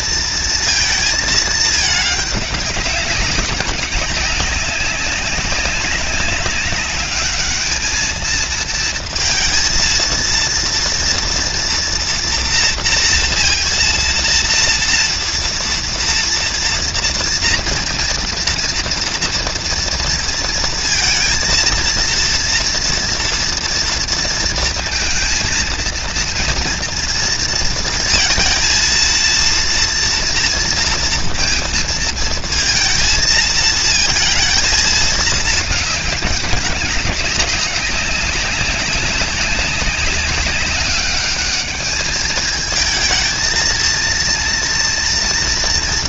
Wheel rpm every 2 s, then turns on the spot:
240, 220, 190, 200, 210, 230, 240, 230, 230, 230, 230, 230, 230, 230, 230, 230, 230, 220, 220, 200, 190, 200, 220.
none